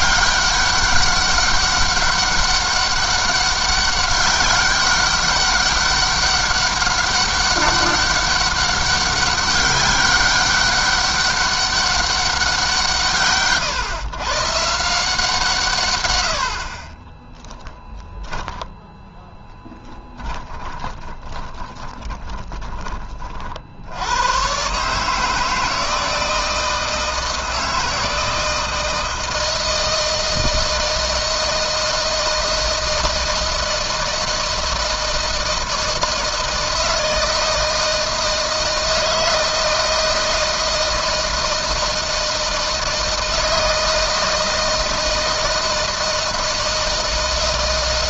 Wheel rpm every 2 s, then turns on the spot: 200, 200, 200, 200, 190, 200, 170, 170, 30, 10, 30, 30, 140, 160, 160, 160, 160, 160, 160, 160, 160, 160, 160, 160.
16-18 20-22